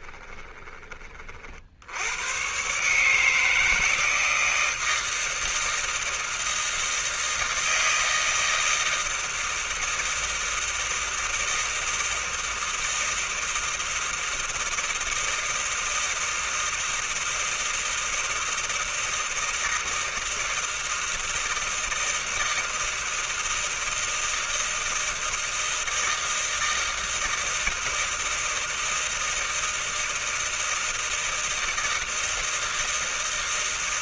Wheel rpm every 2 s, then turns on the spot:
20, 90, 160, 160, 160, 160, 160, 170, 160, 160, 160, 160, 160, 160, 160, 160, 160.
0-2